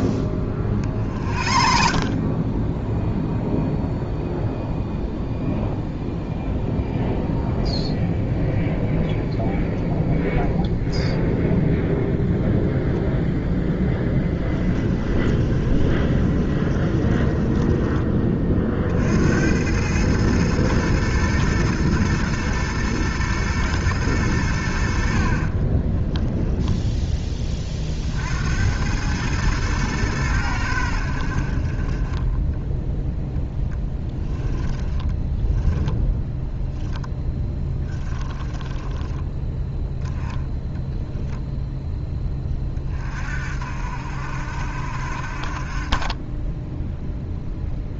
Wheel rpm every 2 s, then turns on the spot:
40, 10, 0, 0, 0, 0, 0, 10, 20, 50, 110, 120, 70, 10, 90, 90, 10, 10, 10, 10, 0, 30, 60, 0.
14-18 34-36 38-40